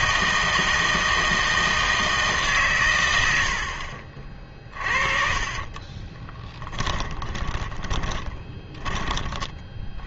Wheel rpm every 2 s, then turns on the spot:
160, 130, 40, 20, 20.
4-10